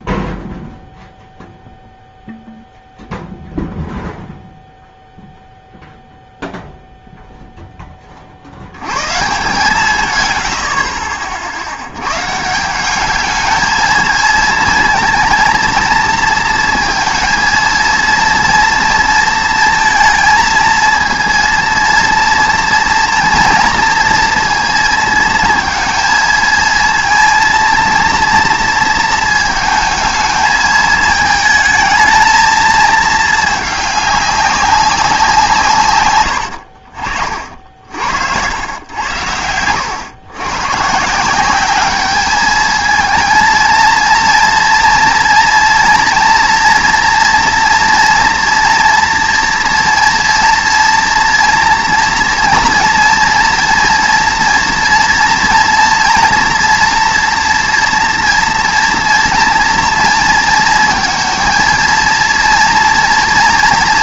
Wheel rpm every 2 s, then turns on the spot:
0, 0, 0, 0, 80, 80, 170, 220, 230, 230, 230, 230, 230, 230, 230, 220, 220, 200, 70, 100, 120, 220, 230, 240, 230, 230, 230, 230, 230, 230, 230, 230.
none